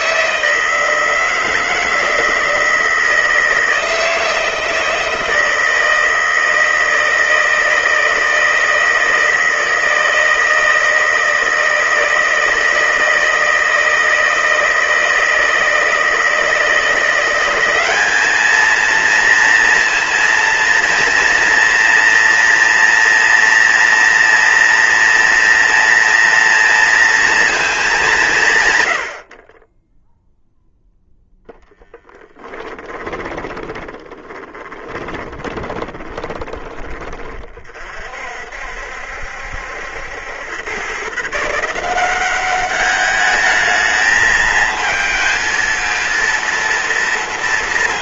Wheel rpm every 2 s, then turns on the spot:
160, 160, 160, 160, 160, 160, 160, 160, 170, 220, 230, 230, 230, 230, 130, 0, 20, 20, 20, 60, 110, 200, 220, 230.
32-36